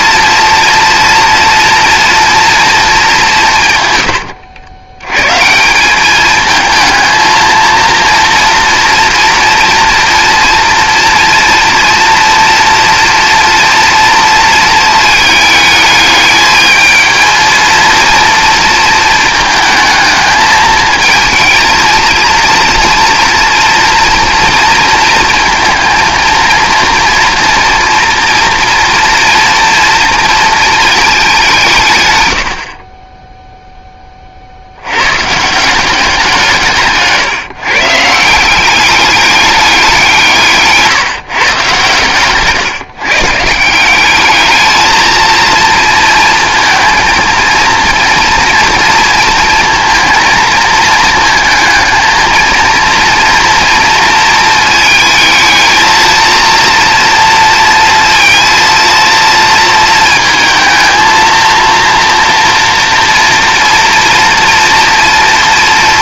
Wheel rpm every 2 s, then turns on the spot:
240, 220, 100, 220, 230, 230, 240, 220, 220, 230, 220, 230, 230, 230, 230, 220, 50, 90, 150, 200, 150, 140, 220, 230, 230, 220, 230, 230, 230, 230, 230, 230, 230.
36-38